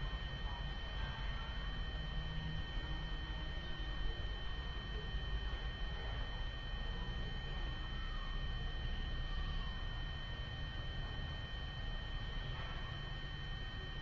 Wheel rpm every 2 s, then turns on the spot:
0, 0, 0, 0, 0, 0, 0.
none